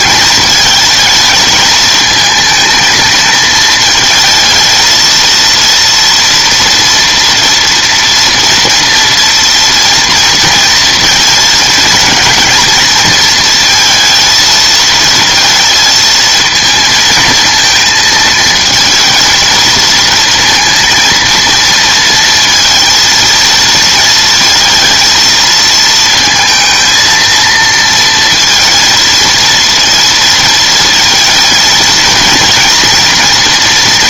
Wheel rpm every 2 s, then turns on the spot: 220, 220, 220, 230, 230, 230, 220, 230, 230, 220, 230, 230, 230, 230, 230, 230, 230.
none